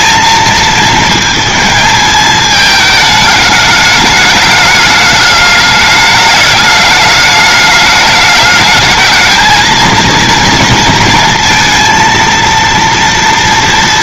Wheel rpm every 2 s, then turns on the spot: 230, 220, 210, 210, 210, 230, 240.
none